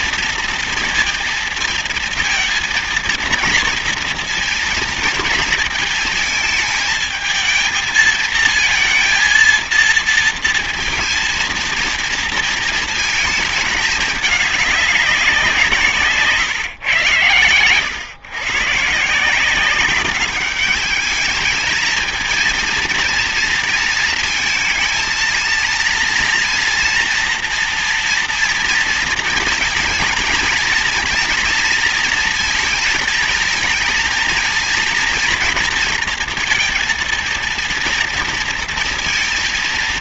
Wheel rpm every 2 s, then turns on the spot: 230, 230, 230, 220, 230, 230, 220, 200, 120, 140, 210, 230, 230, 240, 230, 230, 220, 230, 230, 230.
none